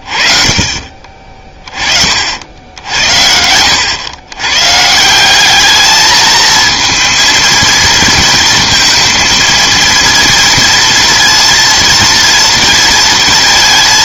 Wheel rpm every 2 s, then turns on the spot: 40, 70, 120, 230, 230, 230, 230.
none